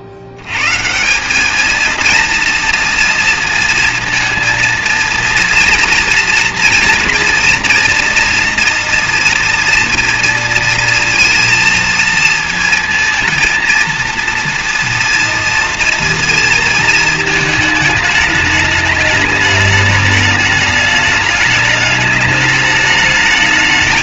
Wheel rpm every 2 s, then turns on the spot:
100, 230, 230, 230, 230, 230, 220, 230, 230, 210, 210, 210.
none